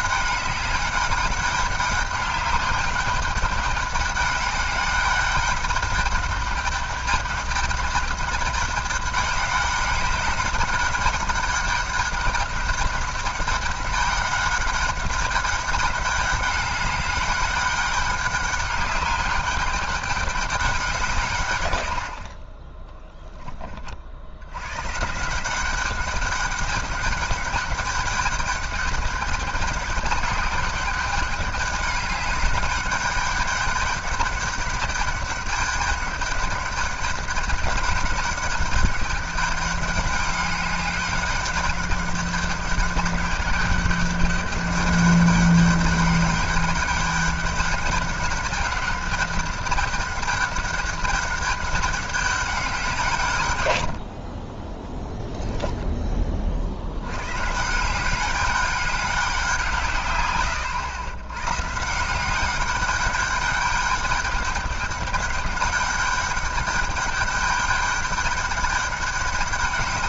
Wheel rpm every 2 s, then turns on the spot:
200, 200, 200, 200, 200, 210, 200, 200, 200, 200, 190, 10, 130, 200, 200, 200, 200, 200, 210, 200, 200, 200, 200, 200, 200, 200, 180, 10, 80, 200, 100, 200, 200, 200, 200.
none